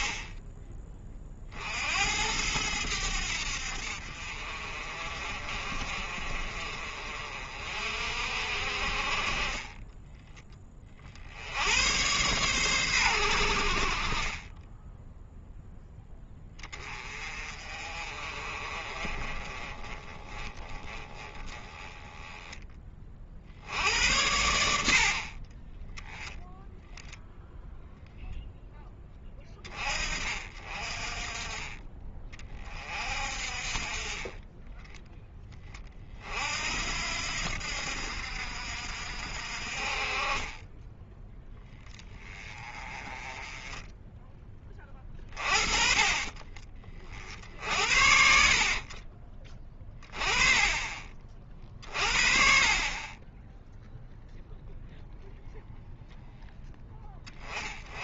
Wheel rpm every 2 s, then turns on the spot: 30, 90, 40, 40, 50, 20, 110, 10, 20, 30, 30, 20, 70, 0, 10, 40, 40, 10, 70, 60, 20, 30, 20, 30, 40, 30, 30, 0, 10.
40-42